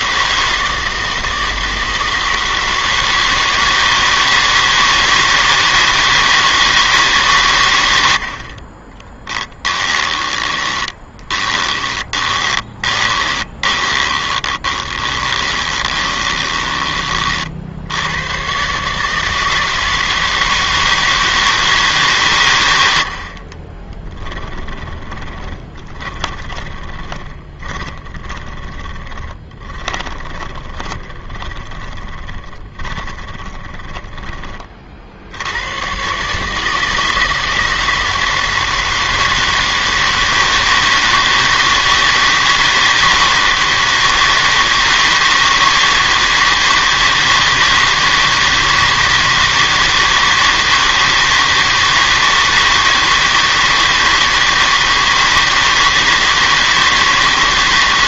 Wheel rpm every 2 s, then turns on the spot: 160, 160, 160, 160, 40, 20, 20, 20, 20, 130, 160, 110, 20, 20, 20, 20, 30, 40, 160, 160, 160, 160, 160, 160, 160, 160, 160, 160, 160.
8-18 24-34